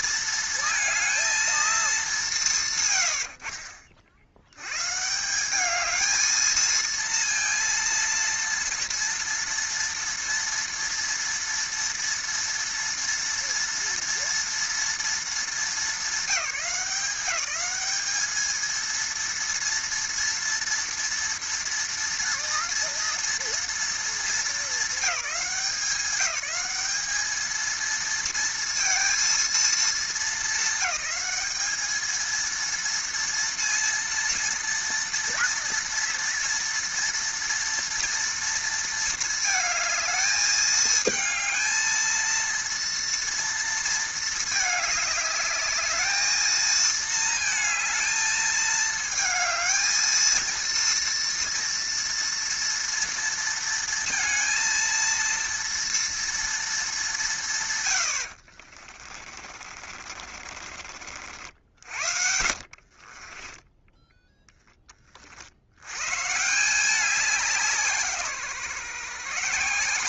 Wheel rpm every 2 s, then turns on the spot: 230, 210, 70, 220, 230, 230, 230, 230, 200, 210, 230, 230, 230, 190, 220, 220, 220, 230, 230, 230, 220, 220, 220, 220, 220, 220, 230, 230, 230, 110, 60, 70, 10, 120, 160.
60-66